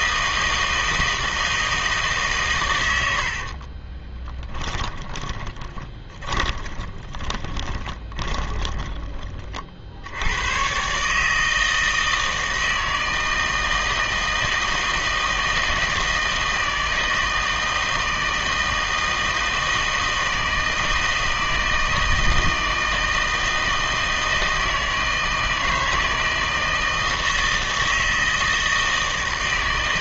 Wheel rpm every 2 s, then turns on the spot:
160, 120, 10, 20, 20, 120, 160, 160, 160, 160, 160, 160, 160, 160, 160.
4-10